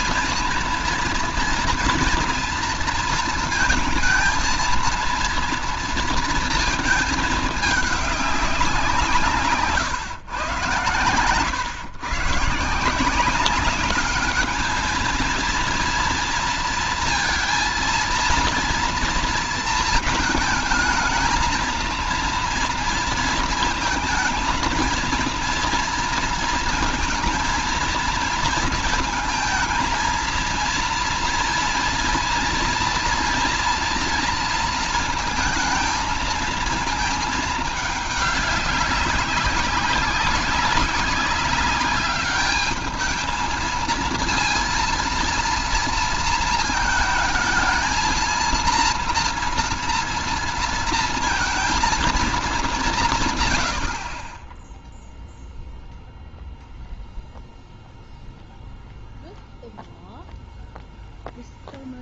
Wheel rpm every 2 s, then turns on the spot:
230, 230, 230, 230, 190, 120, 140, 210, 230, 230, 220, 230, 230, 230, 220, 230, 230, 230, 220, 210, 190, 200, 230, 230, 230, 230, 210, 20, 0, 0, 0.
none